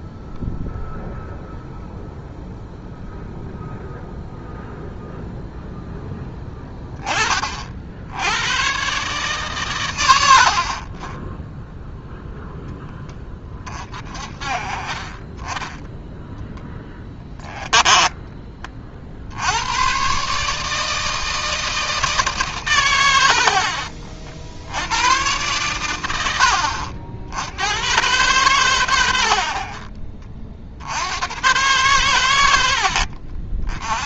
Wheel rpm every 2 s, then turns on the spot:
0, 0, 0, 10, 120, 50, 0, 40, 10, 30, 150, 140, 70, 80, 120, 50, 80.
32-34